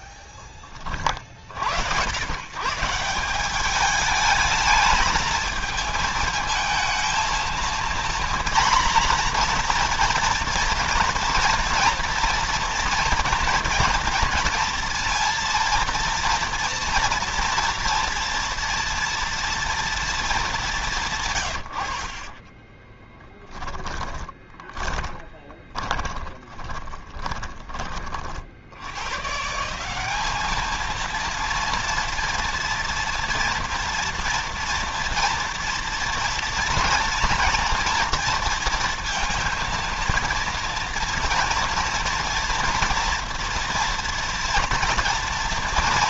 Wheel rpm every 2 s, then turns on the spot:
20, 150, 220, 220, 240, 230, 240, 230, 230, 230, 200, 30, 20, 20, 70, 220, 230, 230, 240, 230, 230, 240, 230.
22-28